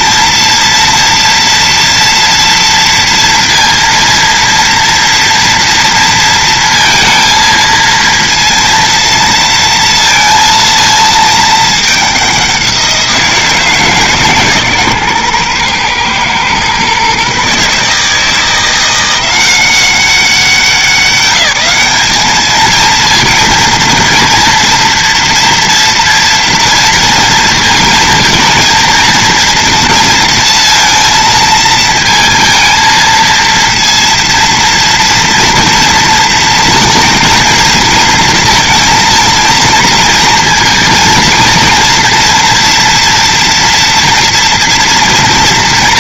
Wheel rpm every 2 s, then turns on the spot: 230, 230, 230, 230, 230, 230, 180, 140, 130, 170, 180, 220, 230, 230, 230, 230, 230, 230, 230, 230, 230, 230, 230.
none